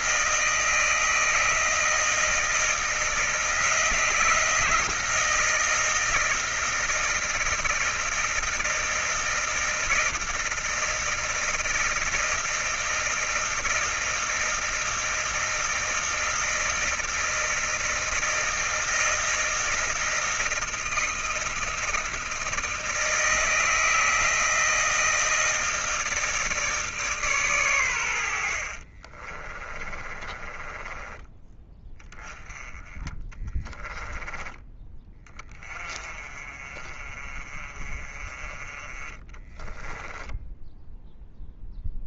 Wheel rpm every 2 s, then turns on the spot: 160, 160, 160, 160, 160, 160, 160, 160, 160, 160, 160, 160, 160, 160, 90, 20, 10, 30, 40, 30, 10.
28-32 40-42